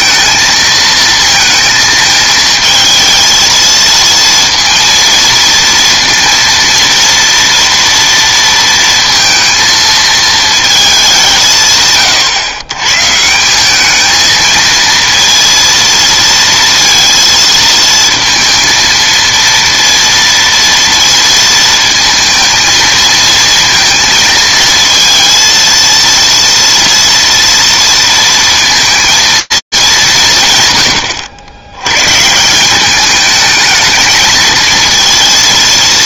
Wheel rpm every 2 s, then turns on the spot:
230, 220, 230, 230, 230, 210, 130, 220, 230, 230, 230, 230, 220, 230, 230, 130, 180, 220.
none